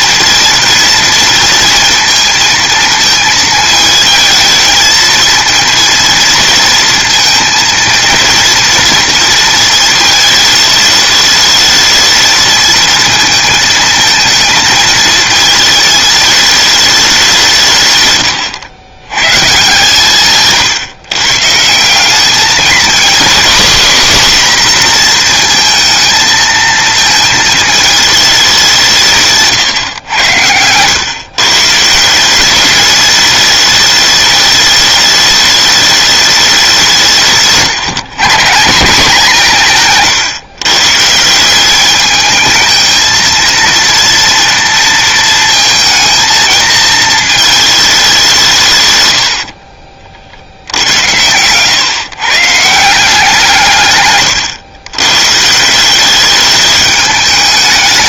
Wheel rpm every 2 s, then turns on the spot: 230, 230, 230, 230, 230, 210, 220, 220, 210, 120, 130, 220, 240, 220, 180, 110, 210, 210, 180, 170, 140, 220, 230, 220, 110, 90, 170, 120, 210.
48-50